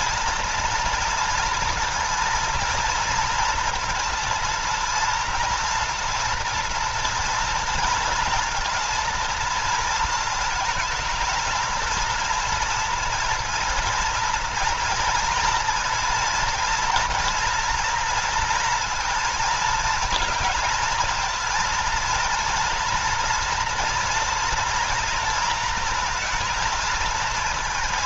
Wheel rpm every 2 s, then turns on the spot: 230, 230, 230, 230, 240, 220, 240, 230, 240, 230, 230, 240, 230, 230.
none